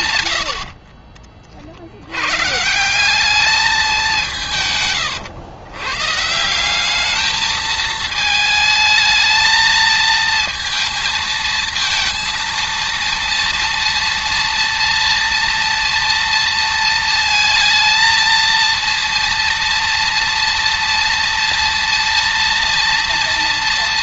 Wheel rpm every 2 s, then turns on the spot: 70, 160, 140, 180, 220, 230, 230, 230, 230, 230, 240, 230.
0-2